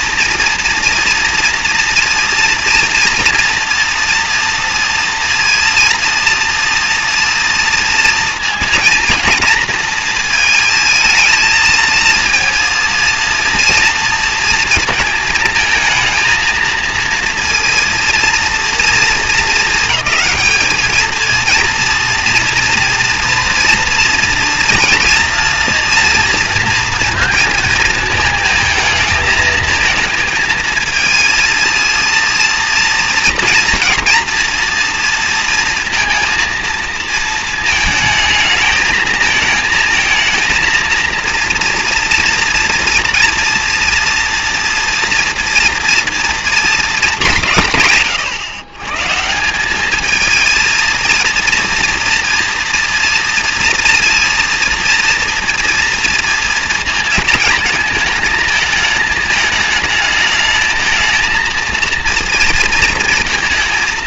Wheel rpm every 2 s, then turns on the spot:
230, 230, 230, 230, 230, 220, 230, 230, 230, 230, 210, 230, 230, 230, 230, 220, 230, 240, 230, 220, 230, 230, 230, 230, 120, 220, 230, 230, 230, 220, 220, 230.
none